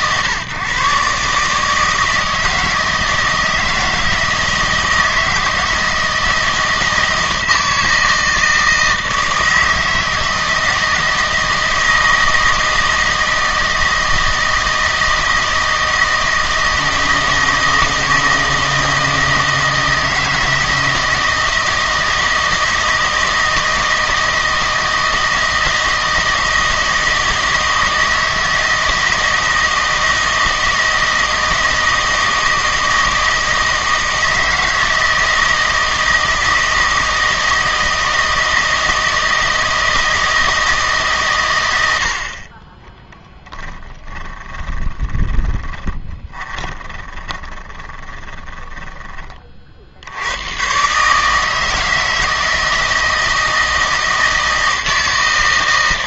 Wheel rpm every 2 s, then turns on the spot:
130, 160, 160, 160, 160, 160, 160, 160, 160, 160, 160, 160, 160, 160, 160, 160, 160, 160, 160, 160, 150, 20, 20, 20, 10, 130, 160, 160.
44-48